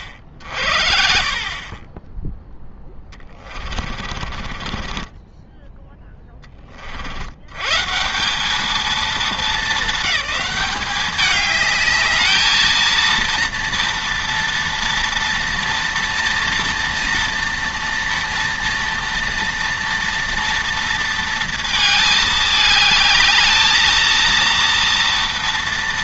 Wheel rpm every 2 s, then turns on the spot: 50, 0, 30, 40, 200, 190, 220, 230, 230, 230, 230, 210, 230.
4-6